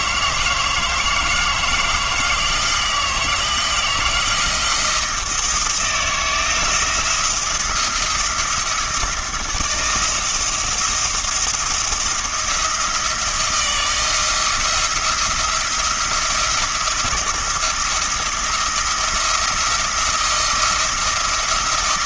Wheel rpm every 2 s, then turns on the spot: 160, 160, 160, 160, 170, 170, 170, 170, 170, 170, 170.
none